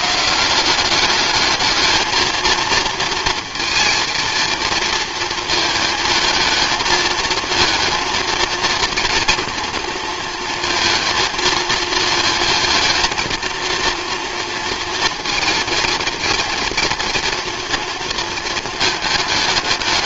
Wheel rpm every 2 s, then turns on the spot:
190, 230, 230, 220, 230, 230, 230, 230, 230, 220.
none